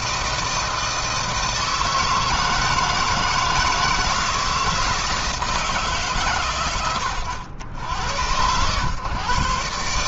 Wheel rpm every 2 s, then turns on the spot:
160, 160, 160, 120, 120.
none